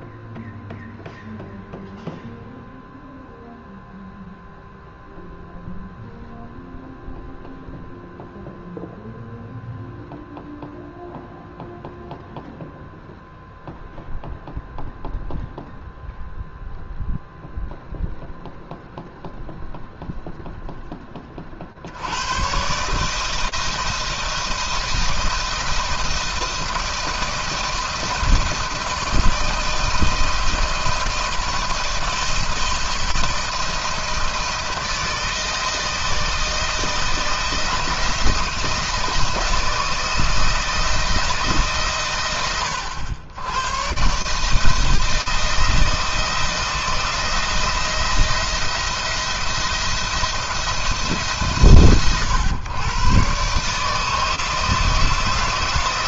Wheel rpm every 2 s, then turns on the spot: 0, 0, 0, 0, 0, 0, 0, 0, 0, 0, 10, 140, 160, 160, 160, 160, 160, 160, 160, 160, 160, 100, 160, 170, 170, 160, 130, 160.
none